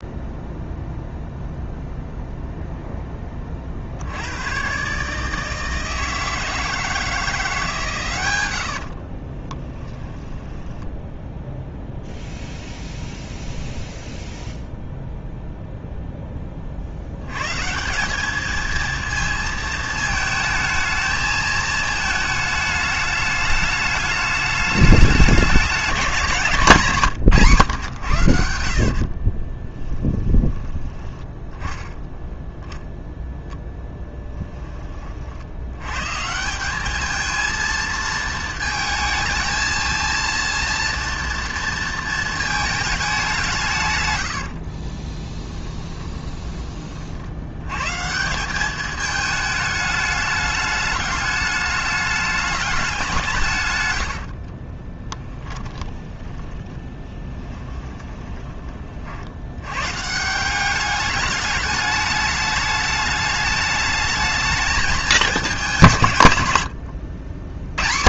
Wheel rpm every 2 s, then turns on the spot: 0, 0, 130, 160, 60, 10, 0, 0, 50, 230, 220, 210, 200, 150, 50, 20, 0, 30, 210, 220, 230, 210, 30, 40, 210, 210, 190, 20, 10, 40, 200, 210, 220, 80.
8-12 28-32 44-46 54-58